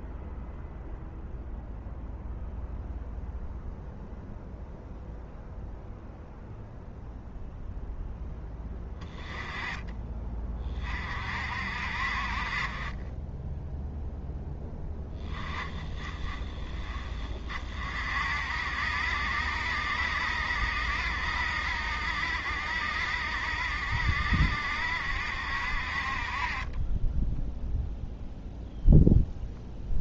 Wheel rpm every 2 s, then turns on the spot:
0, 0, 0, 0, 20, 40, 30, 10, 20, 60, 70, 70, 70, 30, 0.
none